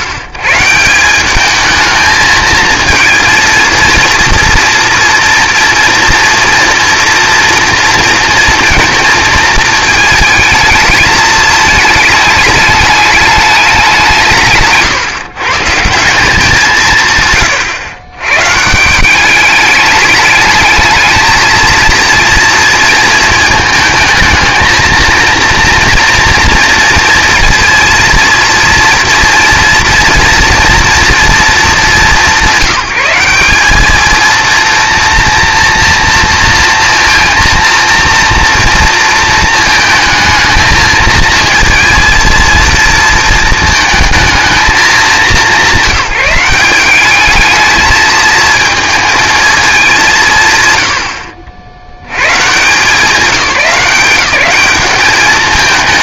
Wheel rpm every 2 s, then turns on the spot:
130, 220, 230, 240, 230, 220, 210, 150, 170, 150, 210, 230, 220, 230, 230, 230, 180, 230, 230, 230, 220, 230, 210, 190, 220, 120, 160, 200.
none